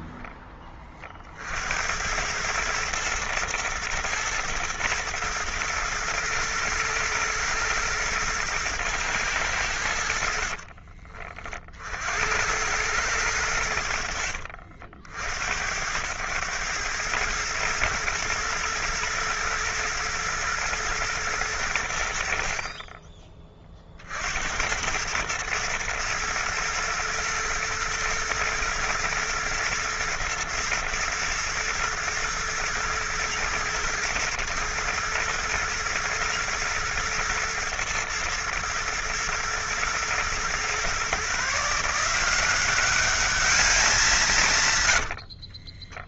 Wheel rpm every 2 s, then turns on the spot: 20, 110, 110, 110, 110, 50, 90, 70, 110, 110, 110, 40, 80, 110, 110, 110, 110, 110, 110, 110, 120, 190, 150.
10-12 44-46